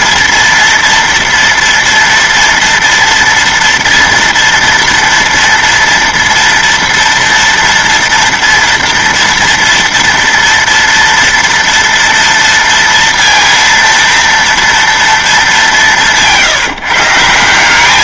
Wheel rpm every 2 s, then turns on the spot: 230, 230, 230, 230, 240, 230, 230, 230, 160.
none